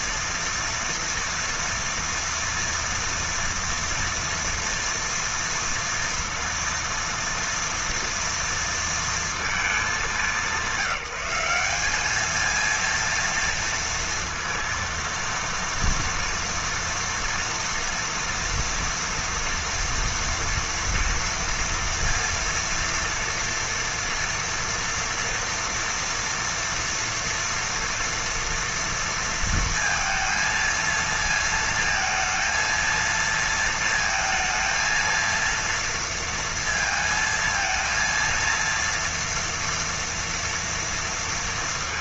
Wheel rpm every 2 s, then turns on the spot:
230, 230, 230, 230, 230, 190, 230, 230, 230, 240, 230, 230, 230, 240, 230, 230, 230, 230, 230, 230, 230.
none